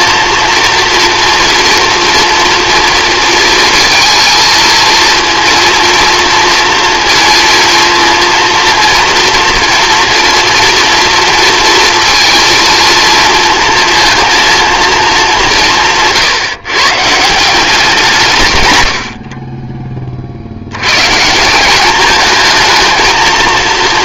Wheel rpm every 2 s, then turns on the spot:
230, 240, 220, 230, 230, 230, 230, 230, 150, 140, 60, 220.
none